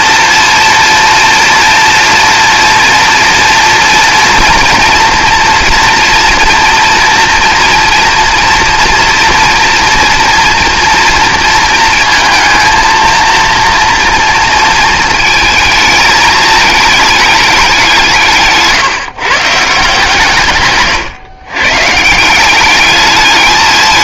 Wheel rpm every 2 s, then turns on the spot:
240, 230, 230, 230, 240, 230, 220, 230, 210, 150, 140, 200.
none